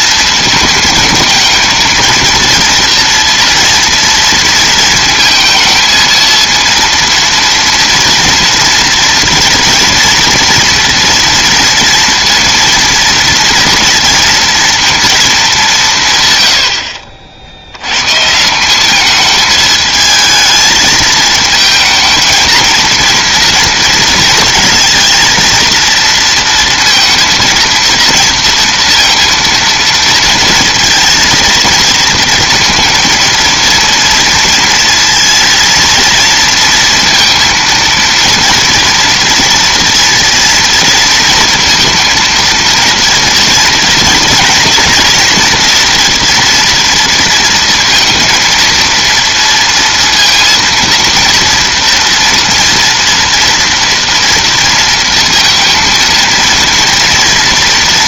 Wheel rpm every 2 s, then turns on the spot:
220, 230, 230, 230, 240, 230, 230, 230, 80, 170, 220, 220, 230, 230, 230, 230, 230, 230, 230, 230, 230, 230, 230, 230, 230, 230, 240, 230, 230.
none